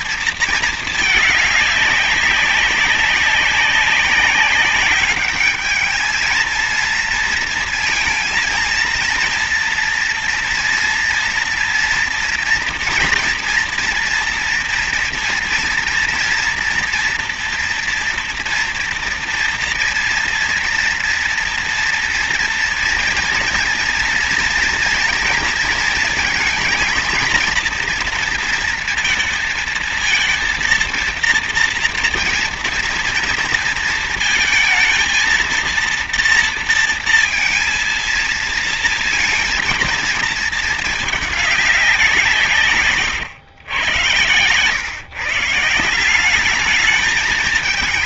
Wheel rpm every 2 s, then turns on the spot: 220, 190, 200, 220, 230, 230, 240, 230, 230, 230, 230, 230, 230, 230, 230, 230, 230, 230, 230, 230, 220, 150, 120, 200.
none